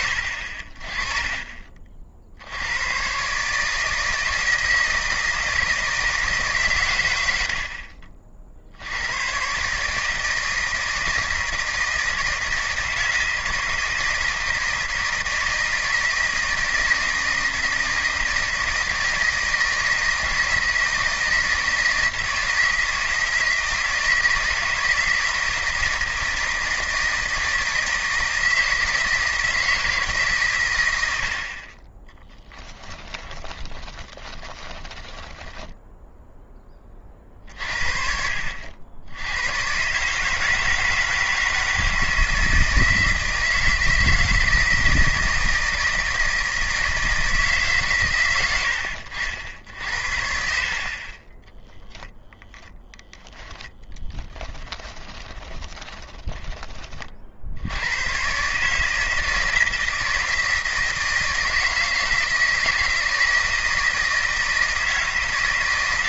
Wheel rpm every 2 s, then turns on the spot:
30, 110, 160, 120, 90, 160, 160, 160, 170, 160, 160, 160, 160, 160, 160, 110, 10, 20, 30, 80, 160, 160, 160, 160, 80, 70, 0, 20, 30, 160, 160, 160, 160.
32-36 50-52 54-56